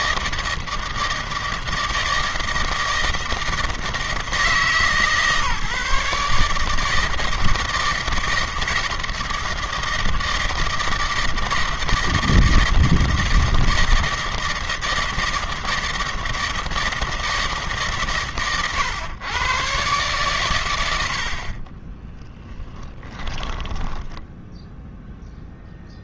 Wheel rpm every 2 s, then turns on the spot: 160, 160, 140, 160, 160, 160, 160, 160, 160, 110, 80, 10, 0.
22-24